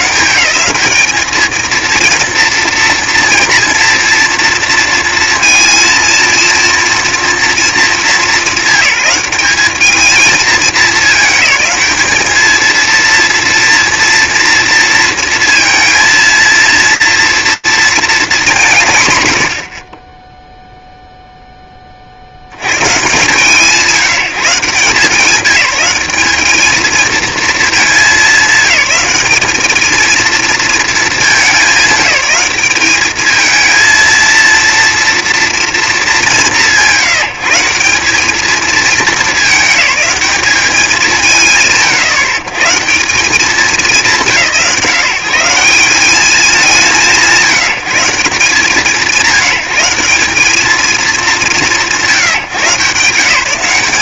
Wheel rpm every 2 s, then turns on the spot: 230, 230, 230, 220, 210, 220, 230, 230, 230, 80, 10, 140, 190, 210, 210, 190, 230, 230, 180, 210, 110, 170, 180, 150, 180, 170, 180.
none